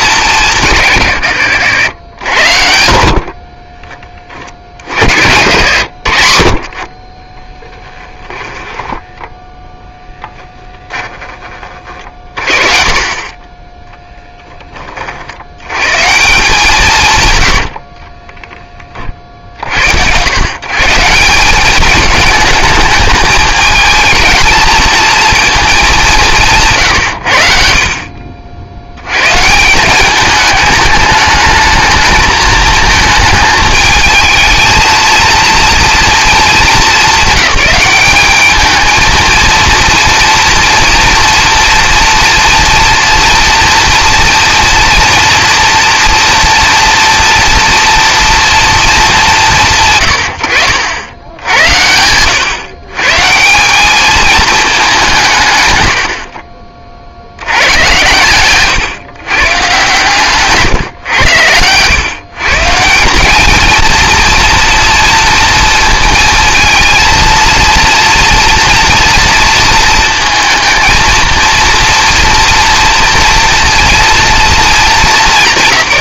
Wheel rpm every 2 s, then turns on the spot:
110, 60, 60, 30, 10, 20, 40, 10, 170, 20, 130, 210, 220, 160, 60, 210, 220, 220, 210, 210, 230, 230, 230, 230, 230, 80, 130, 210, 50, 120, 140, 150, 230, 230, 240, 230, 230, 220.
8-12